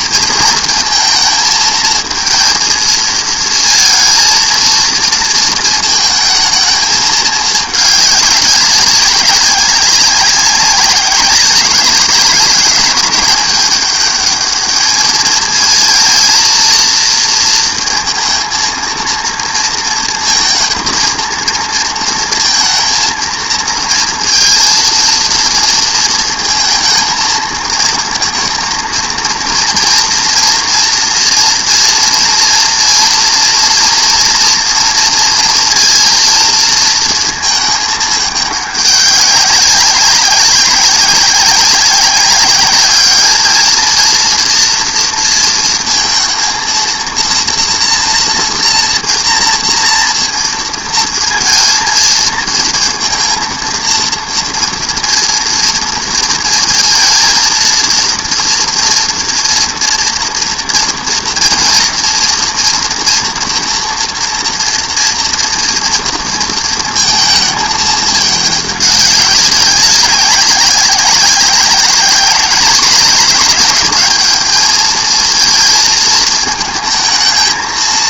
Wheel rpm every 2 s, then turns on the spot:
230, 230, 230, 220, 190, 190, 180, 210, 230, 230, 230, 230, 230, 230, 220, 230, 230, 230, 230, 200, 190, 200, 240, 230, 240, 230, 230, 230, 230, 230, 230, 230, 240, 230, 210, 190, 200, 220, 220.
none